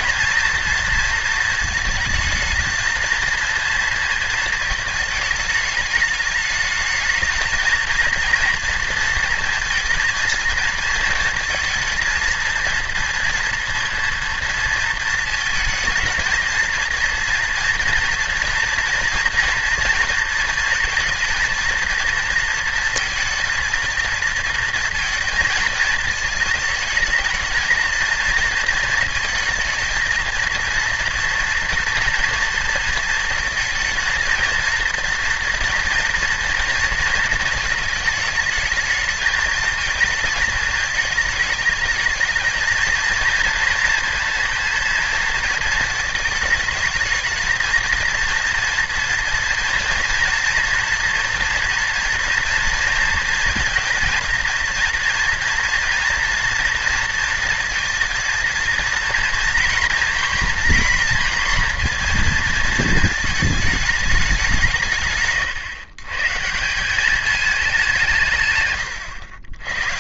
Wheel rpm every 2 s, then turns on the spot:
230, 230, 220, 210, 230, 230, 230, 230, 230, 240, 230, 230, 230, 220, 230, 230, 230, 230, 230, 220, 220, 220, 230, 220, 230, 230, 230, 230, 230, 230, 240, 230, 150, 190, 110.
none